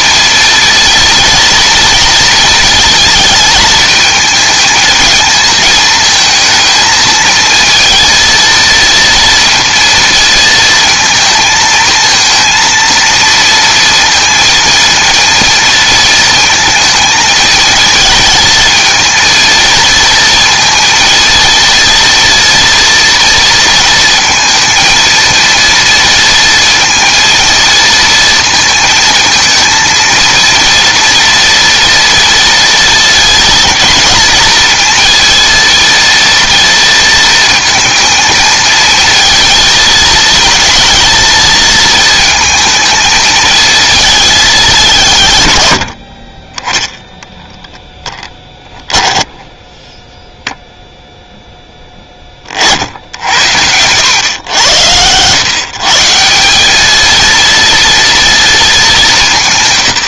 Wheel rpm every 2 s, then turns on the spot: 230, 230, 220, 220, 230, 230, 230, 230, 220, 230, 230, 230, 230, 230, 230, 230, 220, 230, 230, 230, 230, 220, 180, 10, 10, 0, 50, 100, 200, 210.
48-50